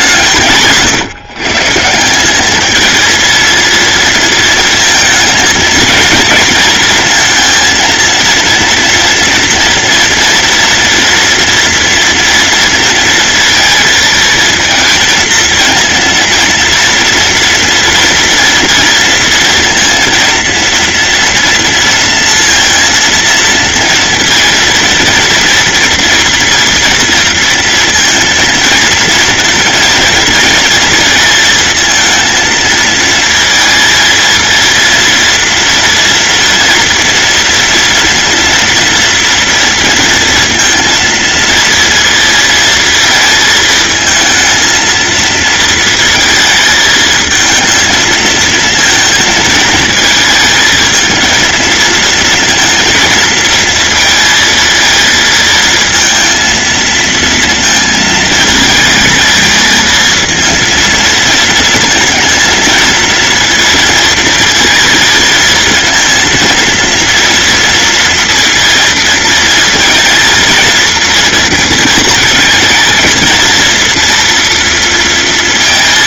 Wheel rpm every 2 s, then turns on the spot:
140, 220, 230, 230, 230, 230, 230, 230, 230, 230, 230, 230, 230, 230, 230, 230, 230, 230, 230, 230, 230, 230, 230, 220, 230, 220, 230, 230, 230, 220, 230, 230, 220, 230, 230, 230, 230, 230.
none